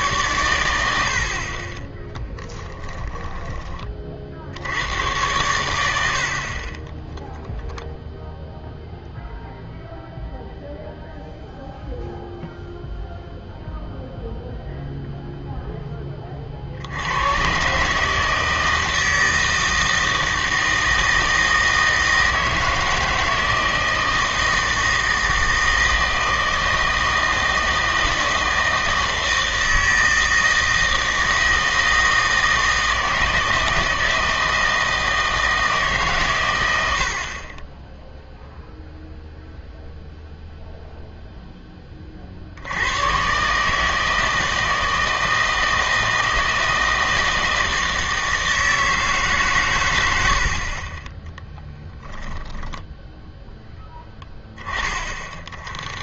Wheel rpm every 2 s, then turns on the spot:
90, 10, 80, 40, 0, 0, 0, 0, 60, 160, 160, 160, 160, 160, 160, 160, 160, 160, 100, 0, 0, 80, 160, 160, 160, 40, 10, 20.
2-4 50-52